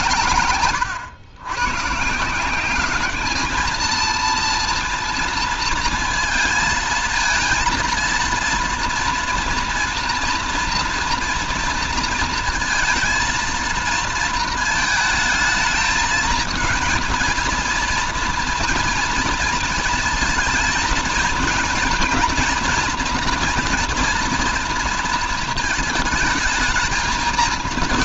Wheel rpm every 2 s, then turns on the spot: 110, 180, 230, 230, 230, 230, 230, 230, 220, 230, 220, 230, 230, 220.
none